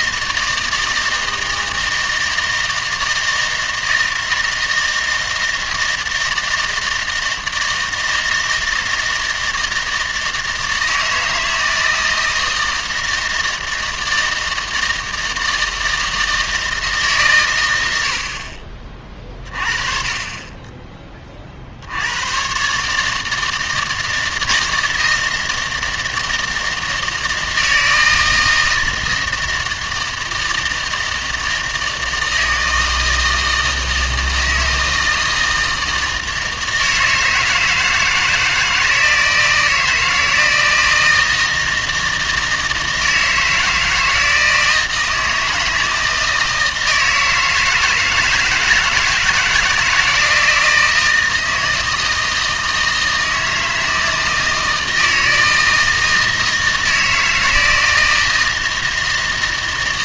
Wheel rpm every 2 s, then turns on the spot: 160, 160, 160, 160, 160, 160, 160, 160, 160, 40, 20, 130, 160, 160, 160, 160, 160, 160, 160, 160, 160, 160, 160, 160, 160, 160, 160, 160, 160, 160.
none